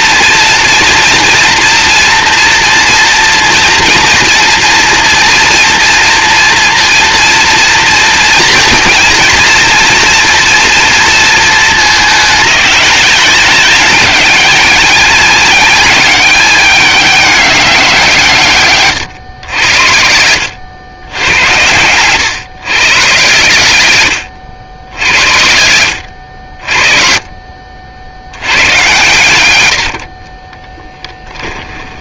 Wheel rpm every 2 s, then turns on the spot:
230, 230, 230, 230, 230, 230, 210, 220, 200, 130, 100, 130, 80, 50, 110, 10.
30-32